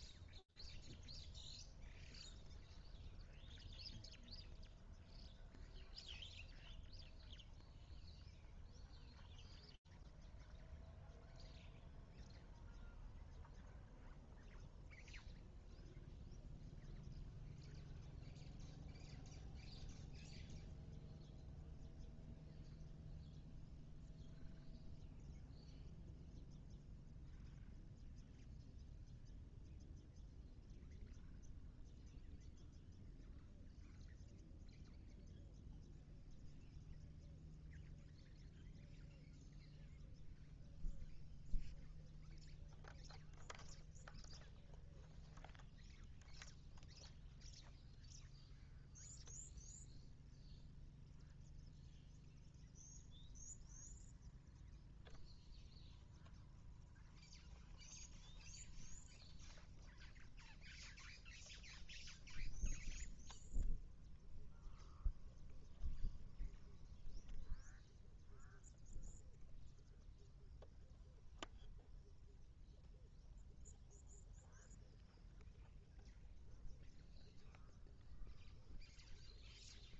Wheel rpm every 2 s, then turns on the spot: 0, 0, 0, 0, 0, 0, 0, 0, 0, 0, 0, 0, 0, 0, 0, 0, 0, 0, 0, 0, 0, 0, 0, 0, 0, 0, 0, 0, 0, 0, 0, 0, 0, 0, 0, 0, 0, 0, 0, 0.
none